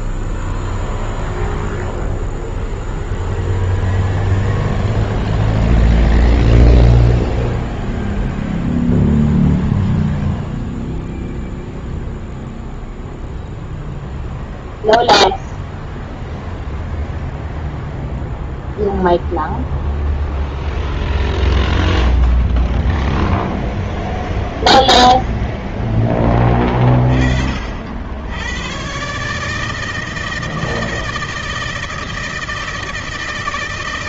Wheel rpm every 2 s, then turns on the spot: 0, 0, 0, 0, 0, 0, 0, 0, 0, 0, 0, 0, 0, 10, 80, 160, 160.
none